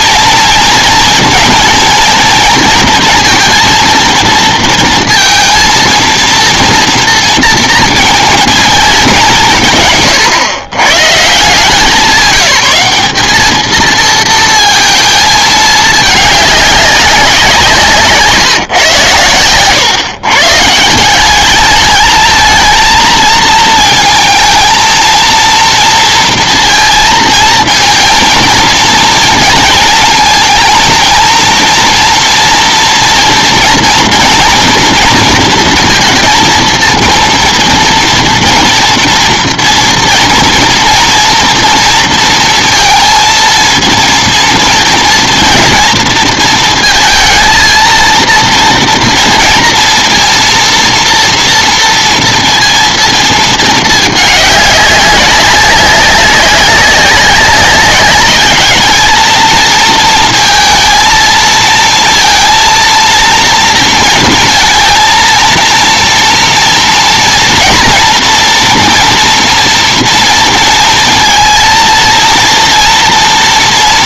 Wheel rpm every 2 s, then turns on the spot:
230, 230, 230, 230, 220, 110, 190, 230, 200, 140, 150, 220, 230, 230, 230, 230, 230, 240, 230, 230, 230, 230, 230, 220, 230, 230, 230, 200, 200, 220, 230, 230, 230, 230, 230, 230, 230.
none